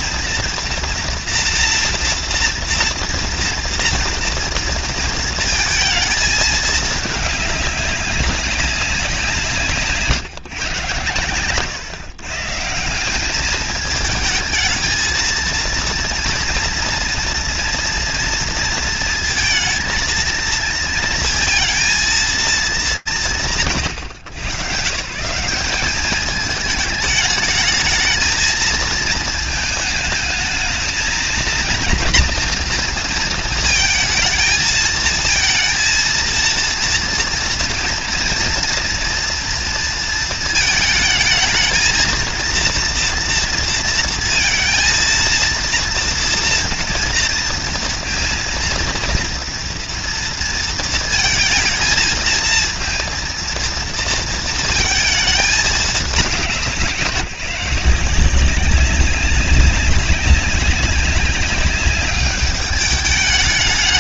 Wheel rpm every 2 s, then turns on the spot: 240, 230, 230, 210, 170, 110, 190, 220, 230, 230, 230, 160, 150, 210, 220, 220, 230, 230, 230, 240, 220, 230, 230, 230, 230, 230, 230, 210, 170, 190, 200, 210.
none